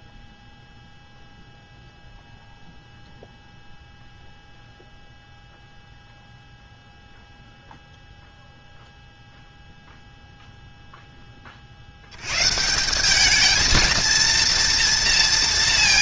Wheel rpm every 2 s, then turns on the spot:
0, 0, 0, 0, 0, 0, 170, 230.
none